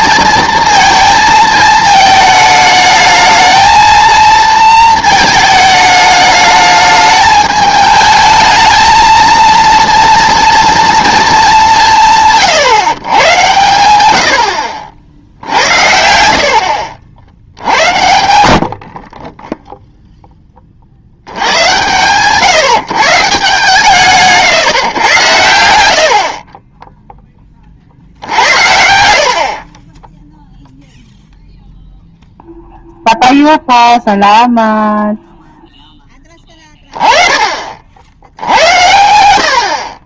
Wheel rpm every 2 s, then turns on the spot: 230, 220, 230, 210, 220, 230, 140, 70, 70, 70, 10, 140, 140, 20, 70, 0, 0, 0, 20, 90.
16-18